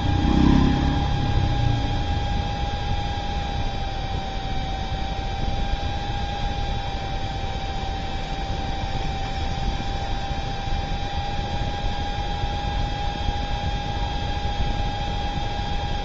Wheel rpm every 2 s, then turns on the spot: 0, 0, 0, 0, 0, 0, 0, 0.
none